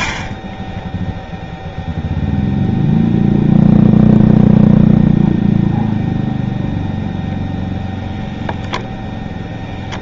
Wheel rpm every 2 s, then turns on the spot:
0, 0, 0, 0, 0.
none